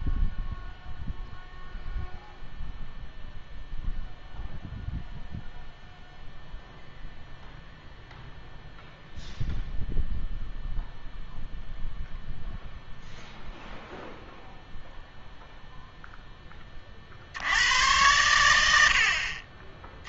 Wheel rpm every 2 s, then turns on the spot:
0, 0, 0, 0, 0, 0, 0, 0, 20, 90.
none